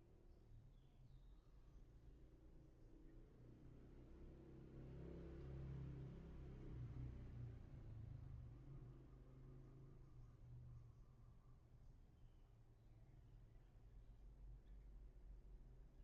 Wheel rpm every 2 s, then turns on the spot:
0, 0, 0, 0, 0, 0, 0, 0.
none